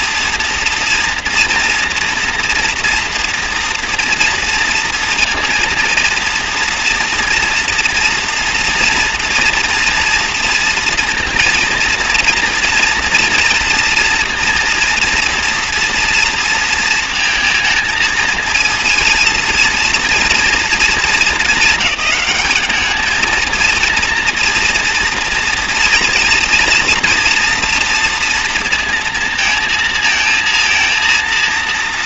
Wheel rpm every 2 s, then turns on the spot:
230, 230, 230, 230, 230, 240, 230, 230, 230, 220, 220, 210, 230, 230, 230, 230.
none